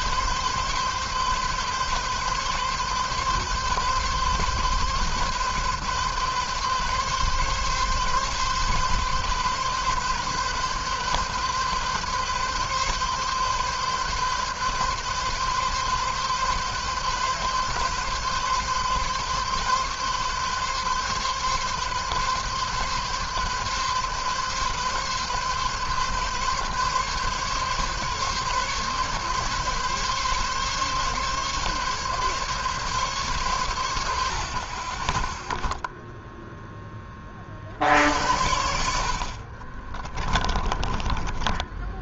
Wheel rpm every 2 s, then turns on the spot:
130, 130, 130, 140, 140, 140, 140, 140, 140, 140, 140, 140, 140, 140, 140, 140, 130, 20, 10, 70, 20.
34-36 40-42